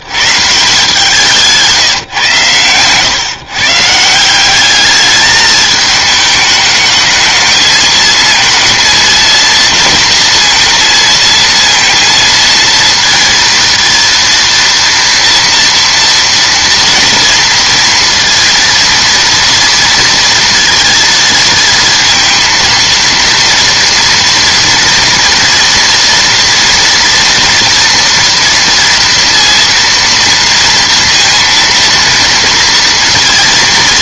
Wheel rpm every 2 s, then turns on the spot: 160, 110, 200, 210, 230, 230, 230, 230, 230, 230, 230, 230, 230, 230, 230, 230, 230.
none